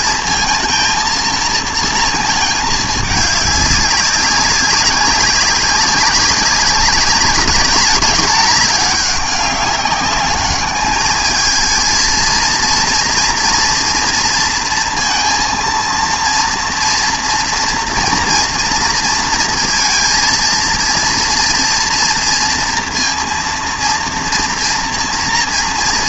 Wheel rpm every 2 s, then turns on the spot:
230, 220, 190, 200, 210, 210, 230, 230, 230, 230, 230, 230, 240.
none